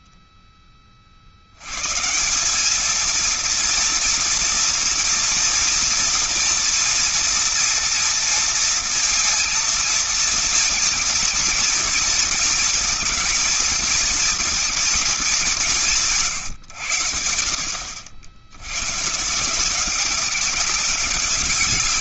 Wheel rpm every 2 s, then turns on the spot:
40, 230, 240, 230, 230, 230, 230, 220, 80, 140, 190.
none